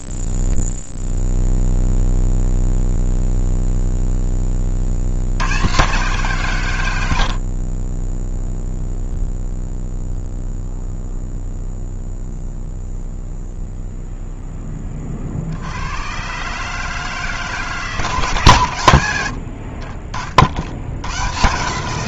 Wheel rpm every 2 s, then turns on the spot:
0, 0, 20, 150, 0, 0, 0, 0, 140, 140, 70.
none